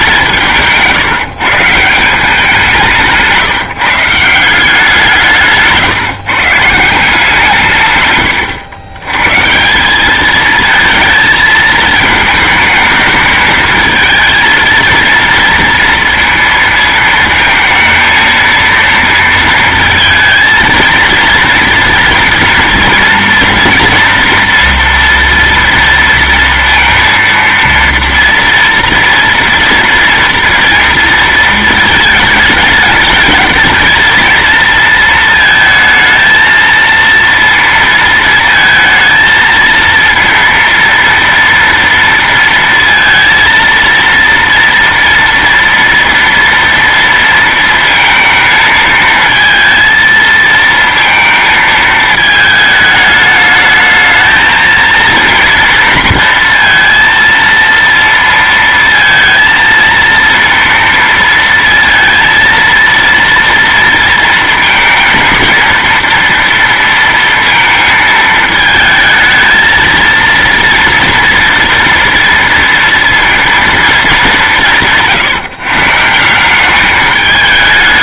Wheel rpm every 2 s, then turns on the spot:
160, 180, 170, 160, 110, 220, 220, 220, 230, 230, 230, 230, 230, 230, 230, 230, 220, 230, 230, 230, 240, 230, 230, 230, 220, 230, 220, 220, 230, 230, 230, 230, 230, 230, 220, 230, 230, 160, 190.
8-10